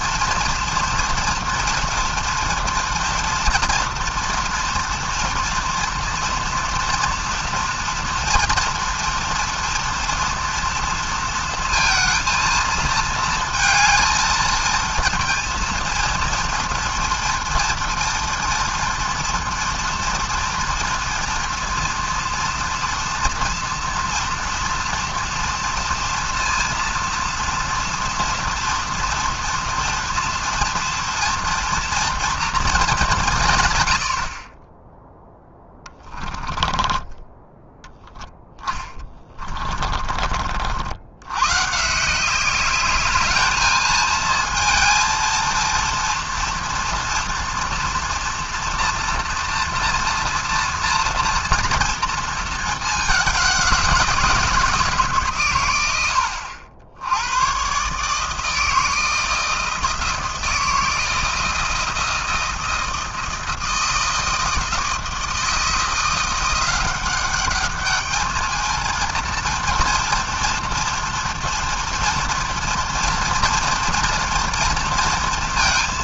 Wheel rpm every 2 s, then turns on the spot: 230, 230, 230, 230, 240, 230, 220, 220, 230, 230, 230, 230, 230, 230, 240, 230, 220, 20, 20, 10, 60, 200, 230, 240, 240, 240, 220, 160, 80, 160, 160, 160, 160, 190, 220, 230, 230, 230.
36-40